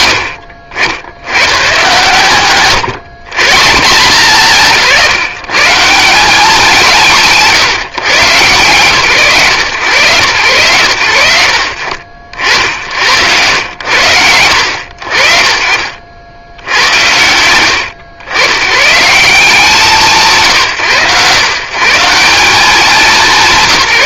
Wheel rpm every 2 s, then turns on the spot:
80, 130, 160, 150, 130, 90, 70, 60, 110, 110, 130, 190.
4-6